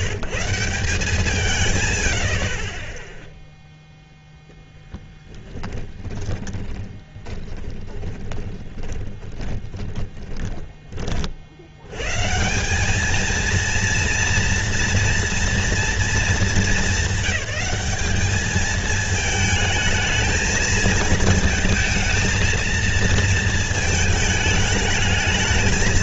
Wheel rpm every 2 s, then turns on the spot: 150, 30, 0, 20, 20, 10, 170, 230, 210, 210, 220, 230, 210.
6-12